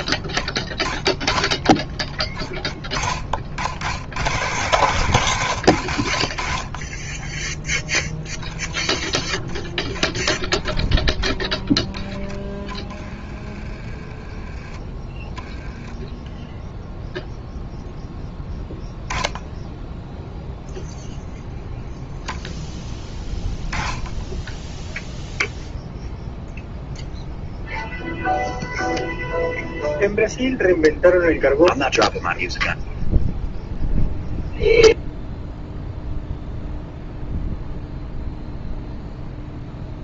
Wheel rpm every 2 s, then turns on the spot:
10, 30, 130, 40, 10, 10, 10, 20, 0, 10, 0, 10, 10, 0, 0, 0, 0, 0, 0, 0.
none